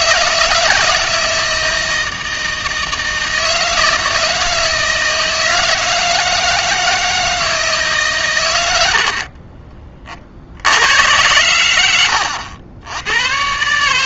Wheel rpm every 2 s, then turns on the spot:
160, 160, 160, 160, 80, 90, 100.
8-10